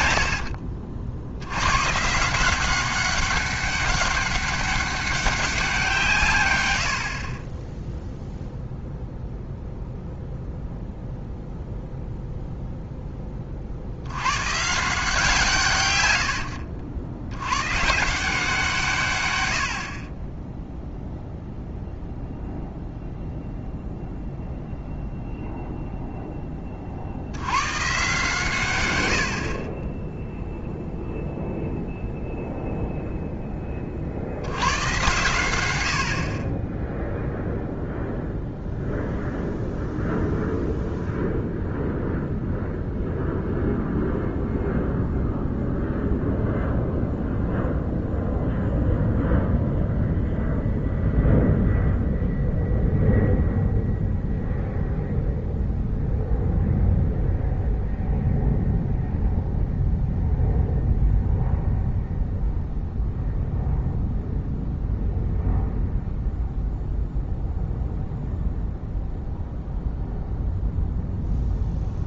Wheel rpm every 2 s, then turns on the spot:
60, 190, 200, 90, 0, 0, 0, 140, 70, 150, 0, 0, 0, 40, 110, 0, 0, 100, 10, 0, 0, 0, 0, 0, 0, 0, 0, 0, 0, 0, 0, 0, 0, 0, 0, 0.
none